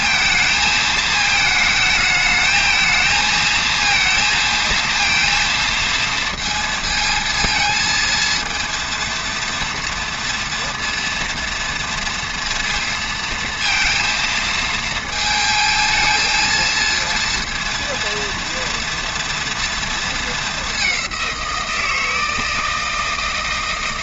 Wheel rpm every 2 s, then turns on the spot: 220, 230, 230, 230, 230, 230, 230, 220, 230, 230, 190, 160.
none